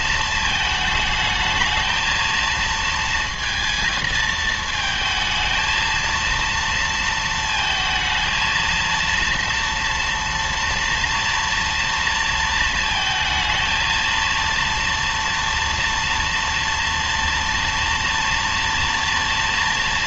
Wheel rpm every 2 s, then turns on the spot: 220, 230, 220, 230, 230, 230, 230, 230, 230, 230.
none